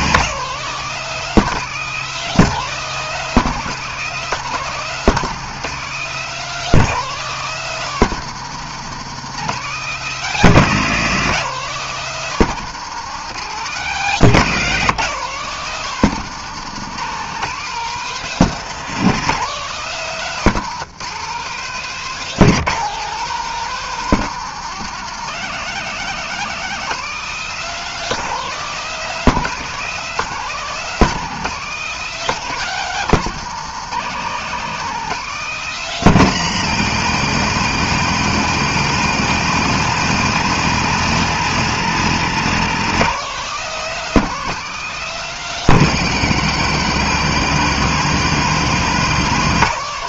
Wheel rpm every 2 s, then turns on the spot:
190, 190, 190, 200, 180, 180, 190, 180, 190, 190, 180, 200, 180, 200, 200, 180, 180, 180, 180, 170, 170, 180, 200, 160, 170.
none